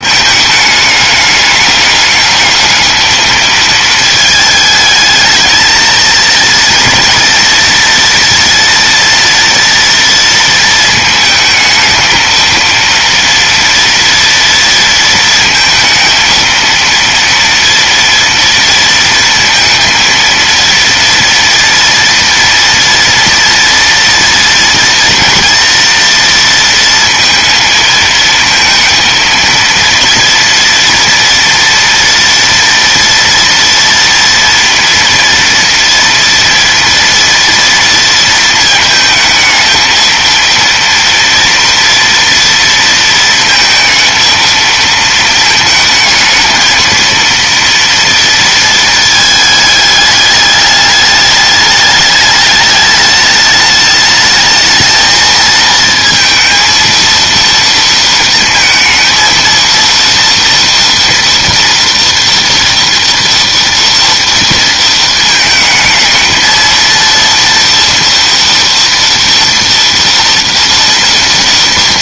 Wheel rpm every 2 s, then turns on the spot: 210, 210, 220, 230, 230, 230, 230, 230, 230, 230, 230, 240, 230, 230, 230, 230, 230, 230, 230, 220, 230, 230, 220, 220, 230, 210, 210, 220, 230, 230, 230, 230, 230, 230, 230, 230.
none